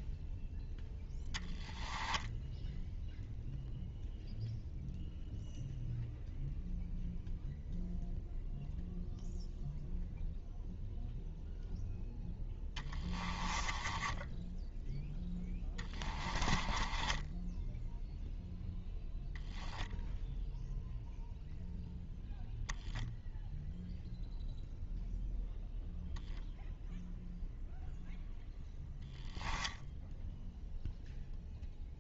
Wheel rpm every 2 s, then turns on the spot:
0, 0, 0, 0, 0, 0, 10, 0, 10, 10, 0, 0, 0, 0, 0, 0.
12-14 16-18